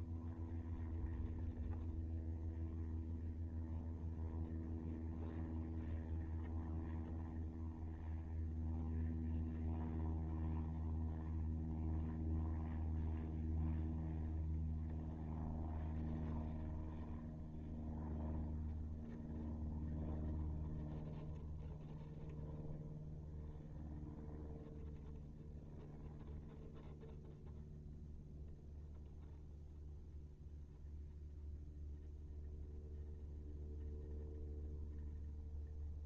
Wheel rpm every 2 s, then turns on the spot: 0, 0, 0, 0, 0, 0, 0, 0, 0, 0, 0, 0, 0, 0, 0, 0, 0, 0.
none